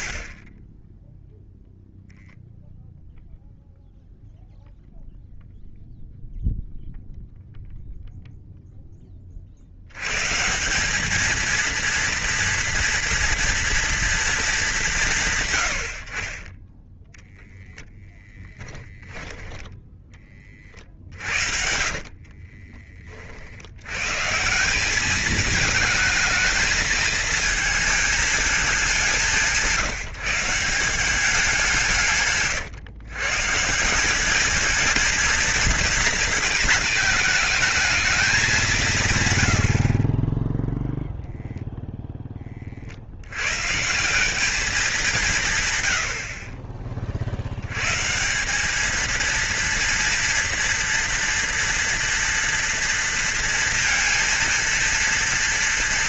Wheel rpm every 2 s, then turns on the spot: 20, 0, 0, 0, 0, 160, 230, 210, 10, 10, 40, 30, 180, 220, 200, 170, 130, 220, 220, 180, 0, 40, 200, 40, 200, 240, 230, 230.
16-20 22-24